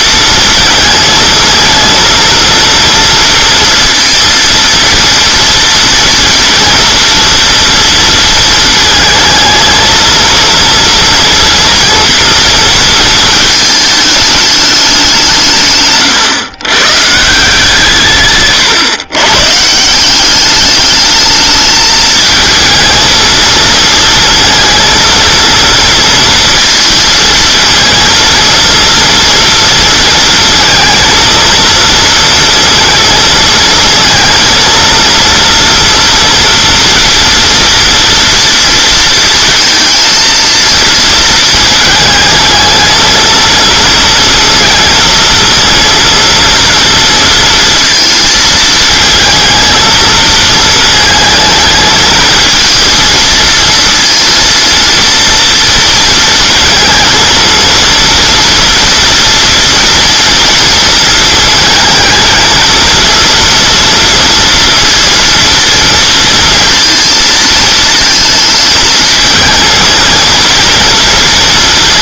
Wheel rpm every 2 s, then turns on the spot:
230, 230, 230, 240, 220, 230, 230, 200, 120, 130, 210, 220, 230, 230, 230, 230, 230, 230, 230, 230, 230, 220, 230, 230, 220, 220, 230, 230, 230, 230, 230, 220, 230, 230, 230, 240.
18-20